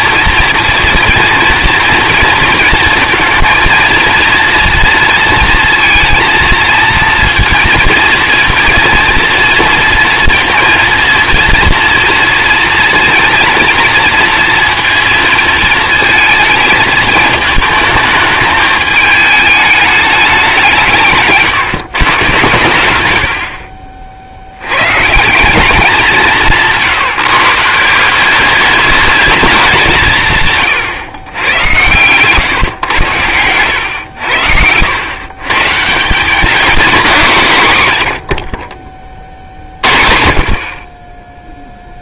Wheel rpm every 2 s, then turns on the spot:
230, 230, 230, 230, 230, 230, 230, 230, 220, 220, 190, 100, 110, 160, 200, 130, 120, 90, 220, 30, 30.
26-28